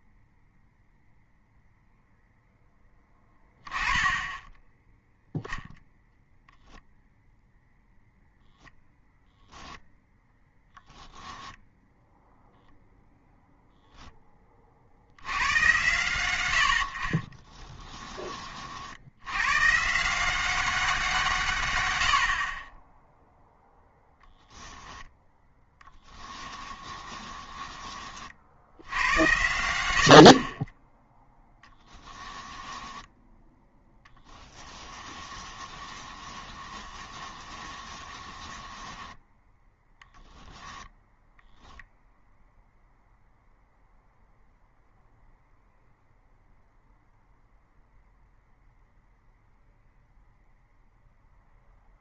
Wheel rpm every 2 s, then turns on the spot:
0, 10, 10, 0, 10, 0, 0, 20, 90, 50, 190, 20, 10, 20, 80, 20, 10, 10, 20, 10, 0, 0, 0, 0, 0, 0.
26-28 32-40